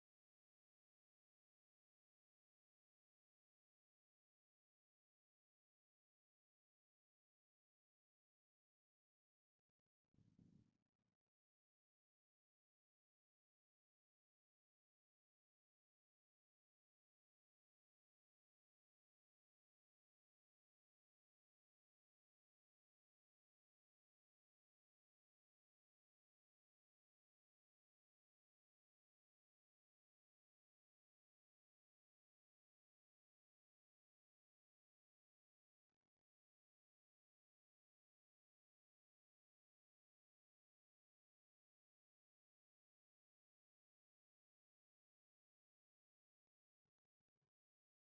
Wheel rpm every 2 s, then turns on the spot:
0, 0, 0, 0, 0, 0, 0, 0, 0, 0, 0, 0, 0, 0, 0, 0, 0, 0, 0, 0, 0, 0, 0, 0.
none